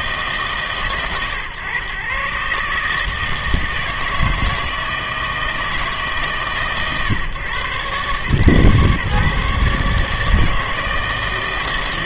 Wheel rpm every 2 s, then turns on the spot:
140, 140, 160, 140, 140, 160.
none